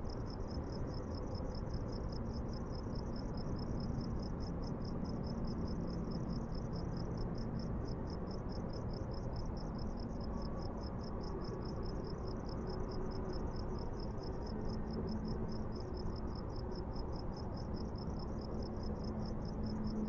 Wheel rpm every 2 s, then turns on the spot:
0, 0, 0, 0, 0, 0, 0, 0, 0, 0.
none